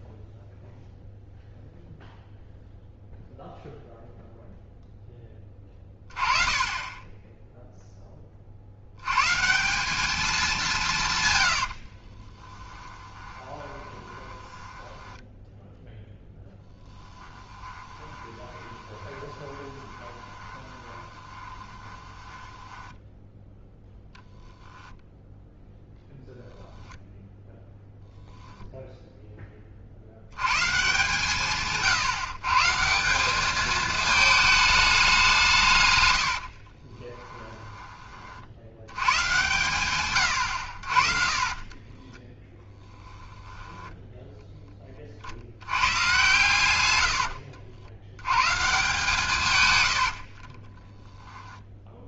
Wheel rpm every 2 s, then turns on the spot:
0, 0, 0, 30, 60, 180, 10, 10, 10, 20, 20, 10, 0, 0, 0, 150, 160, 210, 40, 80, 60, 10, 30, 90, 160, 20.
12-24 36-38 50-52